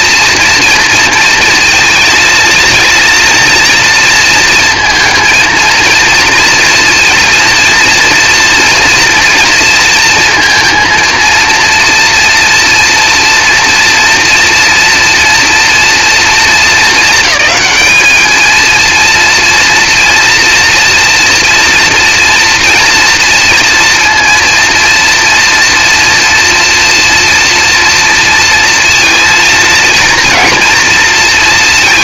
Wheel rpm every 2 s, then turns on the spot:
230, 230, 230, 230, 230, 230, 230, 230, 220, 240, 230, 230, 230, 230, 230, 210.
none